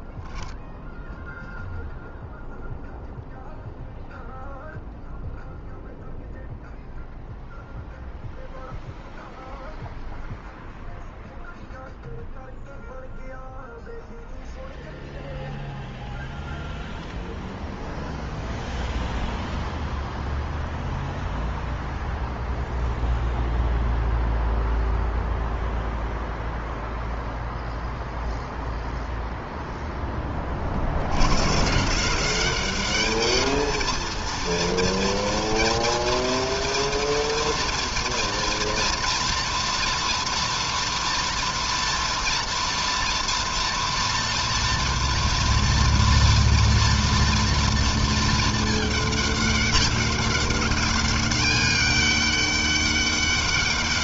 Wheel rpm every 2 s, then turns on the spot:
0, 0, 0, 0, 0, 0, 0, 0, 0, 0, 0, 0, 0, 0, 0, 120, 220, 230, 230, 230, 230, 230, 230, 230, 200, 200, 200.
none